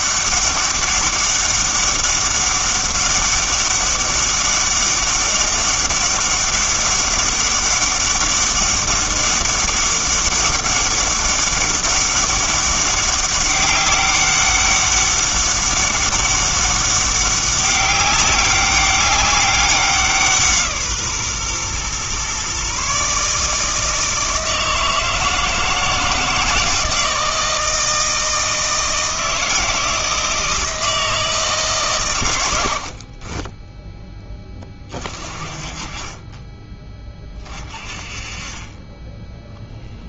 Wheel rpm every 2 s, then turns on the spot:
200, 200, 200, 200, 200, 200, 200, 200, 200, 200, 160, 140, 160, 160, 160, 160, 80, 20, 20, 20.
none